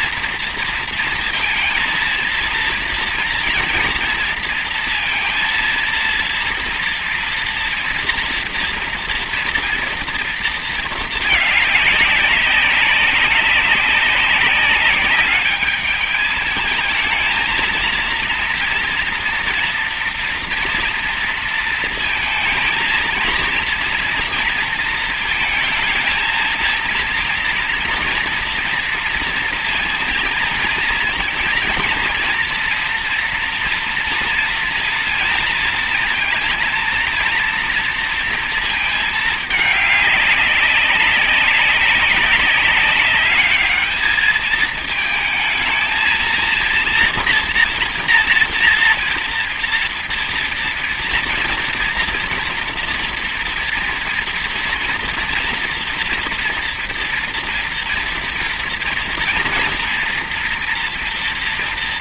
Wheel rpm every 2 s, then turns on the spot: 230, 230, 230, 230, 230, 220, 190, 210, 220, 230, 230, 230, 230, 230, 230, 230, 240, 230, 230, 220, 190, 200, 220, 230, 230, 230, 230, 230, 230, 240, 230.
none